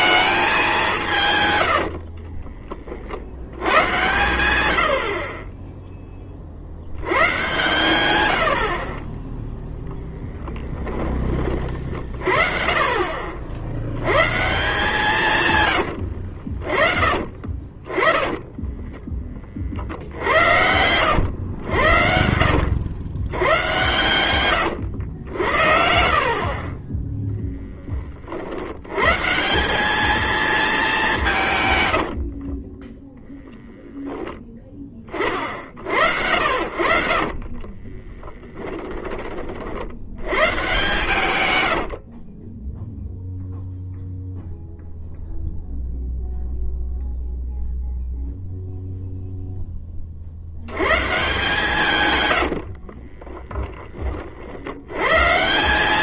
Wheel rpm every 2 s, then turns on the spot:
200, 40, 80, 40, 80, 10, 50, 130, 70, 20, 70, 80, 120, 30, 60, 220, 40, 10, 60, 10, 110, 20, 0, 0, 0, 80, 70, 60.
2-4 8-12 16-20 26-28 32-34 38-40 42-44 52-54